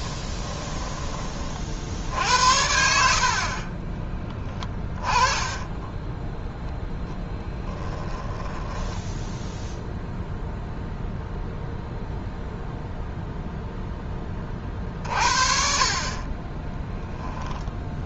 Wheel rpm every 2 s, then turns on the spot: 10, 60, 20, 10, 10, 0, 0, 40, 10.
4-6 8-10